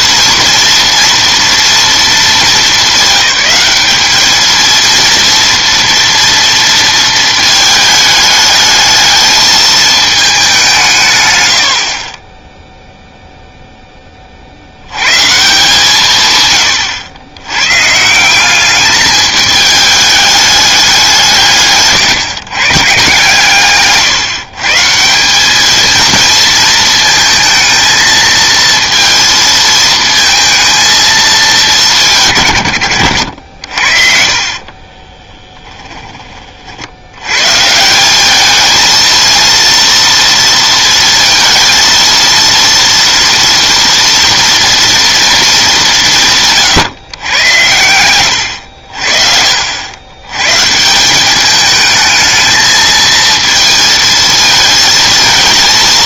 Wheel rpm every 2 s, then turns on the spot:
230, 210, 230, 230, 210, 180, 0, 80, 110, 210, 200, 130, 150, 220, 230, 230, 100, 30, 50, 220, 230, 230, 230, 140, 80, 150, 220, 220.
34-36